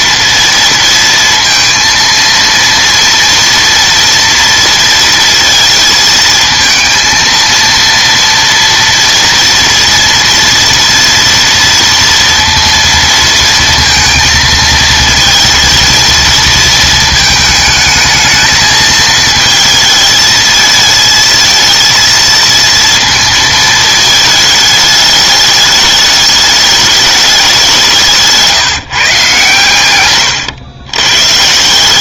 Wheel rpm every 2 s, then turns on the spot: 230, 230, 230, 230, 230, 230, 230, 220, 220, 220, 220, 230, 220, 210, 160, 110.
none